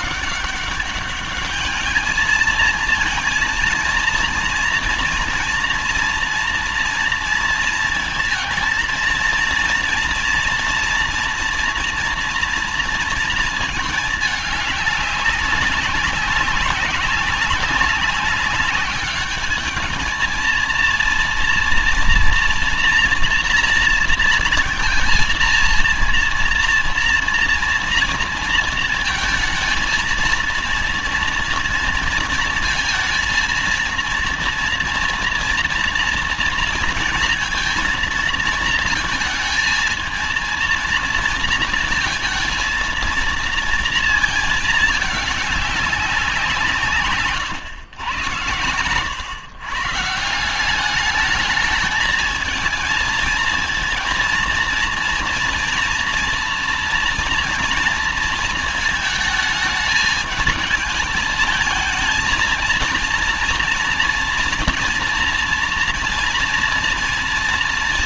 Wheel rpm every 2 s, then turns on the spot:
190, 230, 240, 230, 230, 230, 240, 200, 190, 200, 230, 230, 230, 230, 230, 230, 230, 230, 230, 230, 230, 230, 210, 150, 120, 210, 220, 230, 230, 220, 220, 230, 230, 230.
none